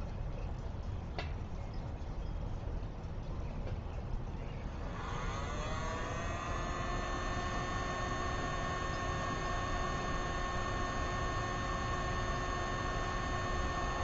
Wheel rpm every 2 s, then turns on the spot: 0, 0, 0, 0, 0, 0, 0.
none